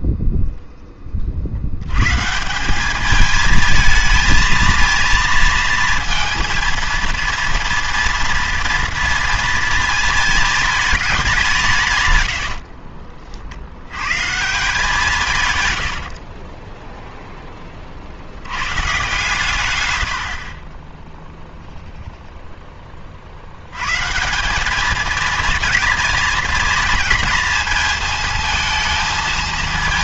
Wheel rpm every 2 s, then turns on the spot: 10, 190, 230, 230, 230, 220, 60, 170, 10, 110, 20, 20, 210, 230, 220.
12-14 16-18